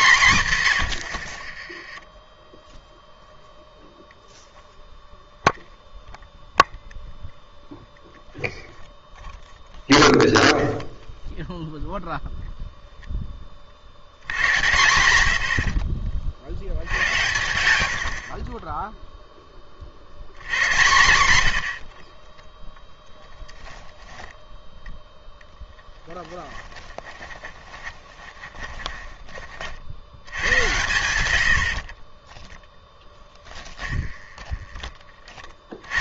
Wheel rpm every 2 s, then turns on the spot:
100, 0, 0, 0, 0, 0, 0, 100, 90, 20, 110, 10, 10, 10, 20, 90, 10, 20.
0-2 26-30 32-34